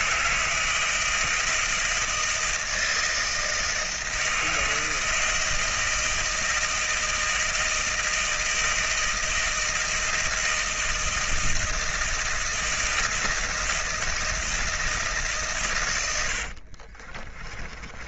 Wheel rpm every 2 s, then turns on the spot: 160, 160, 160, 160, 160, 160, 160, 160, 50.
16-18